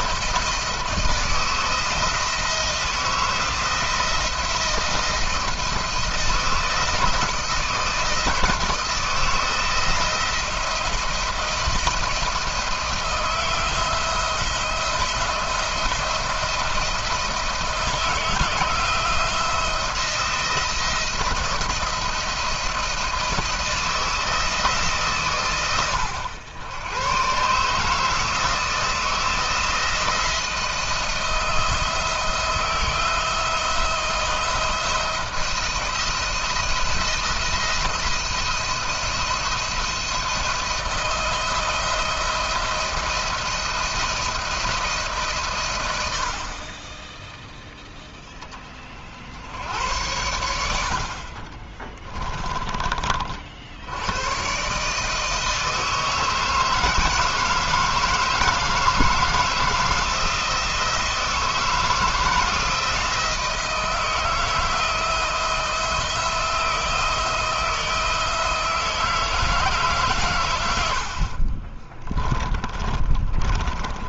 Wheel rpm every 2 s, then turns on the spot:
170, 170, 160, 160, 160, 170, 170, 170, 160, 160, 170, 170, 160, 100, 160, 170, 170, 170, 170, 170, 170, 170, 160, 40, 30, 70, 20, 140, 160, 160, 160, 160, 160, 160, 160, 100, 30.
72-74